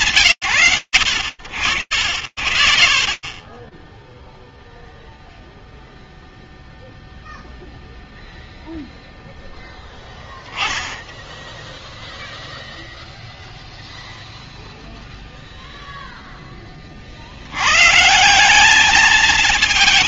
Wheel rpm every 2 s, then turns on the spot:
100, 20, 0, 0, 0, 0, 0, 0, 60, 220.
none